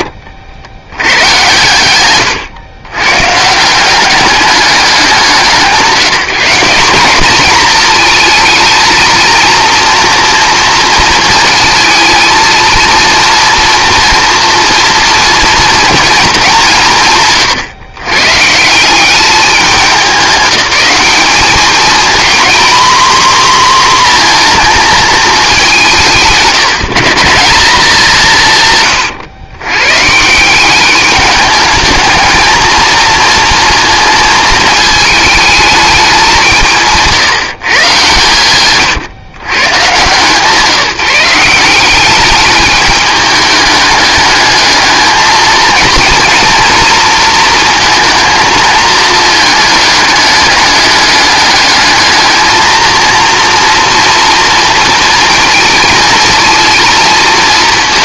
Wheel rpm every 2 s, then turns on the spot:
100, 120, 190, 200, 220, 230, 230, 230, 160, 190, 190, 240, 220, 160, 140, 200, 230, 220, 170, 130, 160, 210, 220, 230, 220, 200, 230, 230, 220.
28-30